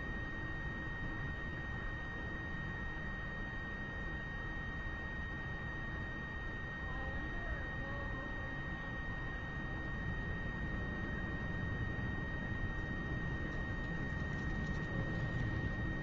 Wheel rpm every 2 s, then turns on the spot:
0, 0, 0, 0, 0, 0, 0, 0.
none